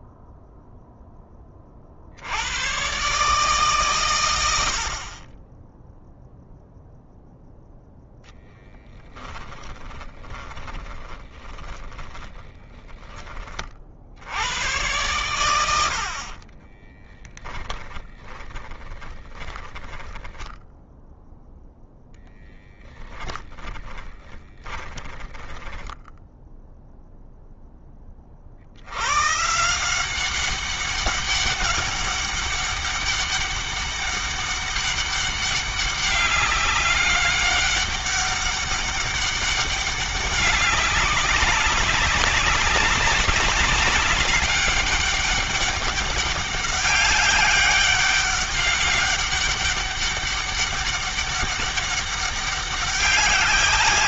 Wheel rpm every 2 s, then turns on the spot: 0, 110, 80, 0, 10, 20, 20, 100, 10, 20, 10, 10, 10, 0, 70, 200, 190, 200, 200, 200, 200, 200, 200, 200, 200, 200, 200.
8-14 16-20 24-26